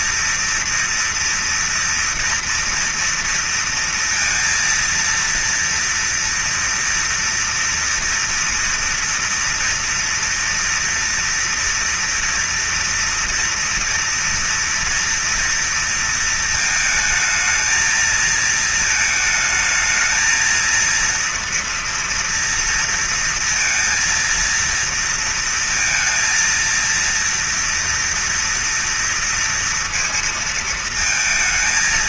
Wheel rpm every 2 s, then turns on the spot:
230, 230, 230, 230, 230, 230, 230, 230, 220, 220, 230, 230, 230, 230, 230, 220.
none